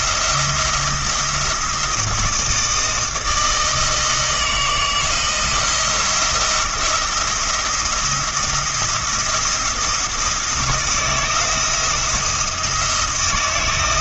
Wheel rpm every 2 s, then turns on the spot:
170, 160, 170, 170, 170, 170, 160.
none